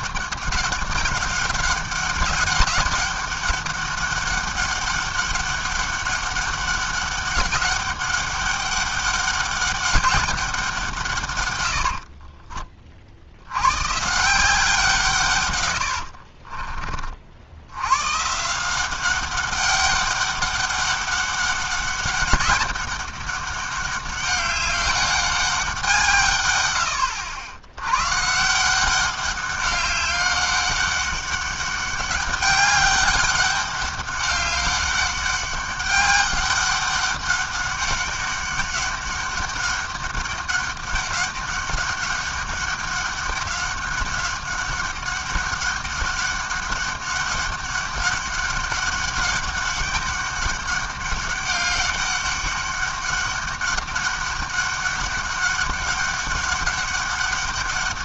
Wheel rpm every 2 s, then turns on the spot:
190, 200, 200, 200, 200, 190, 30, 170, 40, 170, 200, 200, 200, 100, 170, 200, 200, 200, 200, 200, 200, 200, 200, 200, 200, 200, 200, 200, 200.
16-18